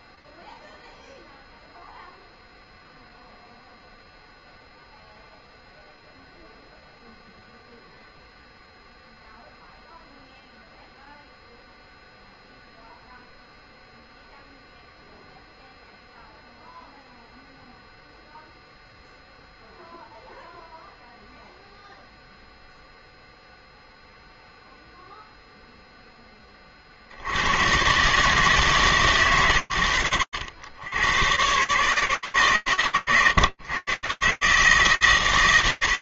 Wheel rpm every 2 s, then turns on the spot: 0, 0, 0, 0, 0, 0, 0, 0, 0, 0, 0, 0, 0, 50, 120, 100, 110, 150.
none